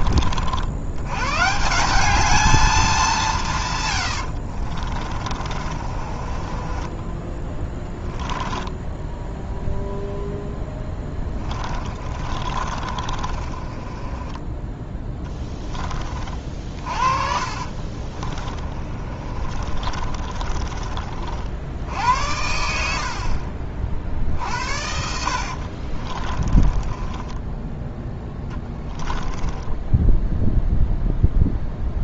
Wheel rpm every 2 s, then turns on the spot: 100, 200, 40, 20, 10, 10, 30, 10, 40, 40, 40, 70, 70, 20, 10, 0.
4-14 16-20 24-30